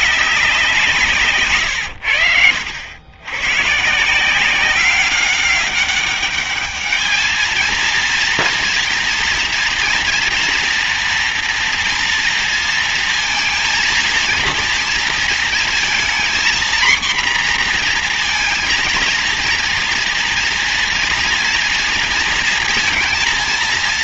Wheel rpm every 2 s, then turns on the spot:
190, 90, 170, 200, 230, 230, 230, 230, 240, 230, 230, 230.
none